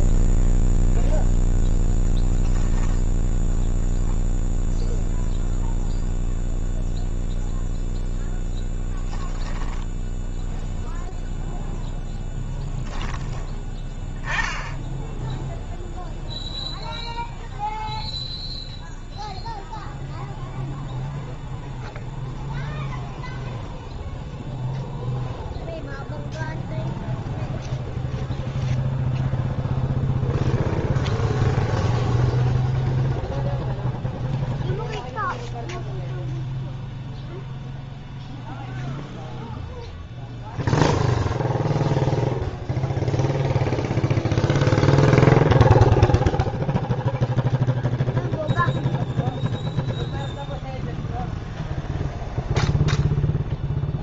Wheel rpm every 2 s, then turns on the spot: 0, 0, 0, 0, 10, 0, 10, 10, 0, 0, 0, 0, 0, 0, 0, 0, 0, 0, 0, 0, 0, 0, 0, 0, 0, 0, 0.
8-10